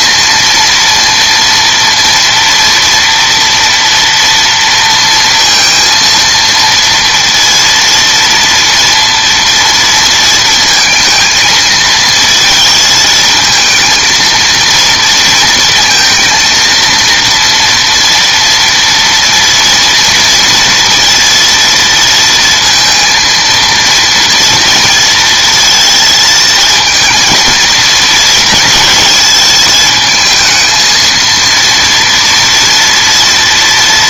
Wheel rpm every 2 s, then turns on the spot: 230, 230, 230, 230, 230, 230, 230, 230, 230, 230, 230, 230, 230, 220, 220, 220, 230.
none